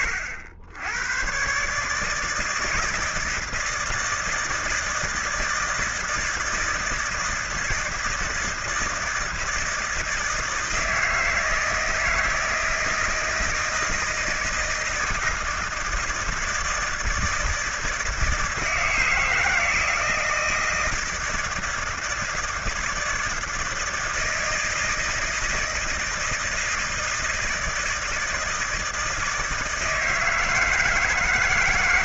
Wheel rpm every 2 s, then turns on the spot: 90, 160, 160, 160, 160, 160, 160, 160, 160, 160, 160, 160, 160, 160, 160, 160.
none